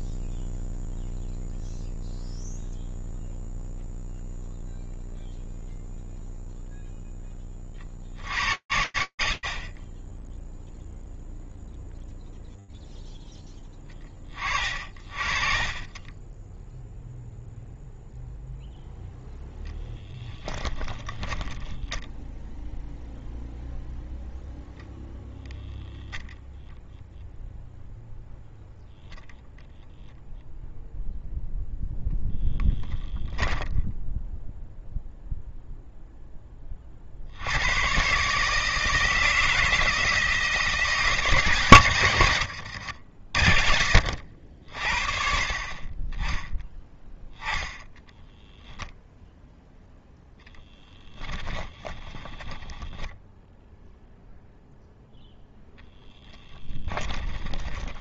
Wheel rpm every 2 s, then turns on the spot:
0, 0, 0, 0, 40, 0, 10, 30, 0, 10, 10, 0, 0, 0, 0, 0, 0, 0, 100, 160, 140, 60, 30, 0, 0, 20, 10, 0, 20.
18-22 50-52 56-58